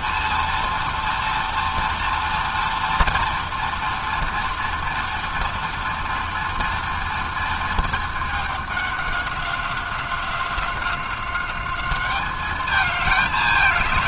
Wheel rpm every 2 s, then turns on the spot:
240, 240, 230, 230, 190, 190, 220.
none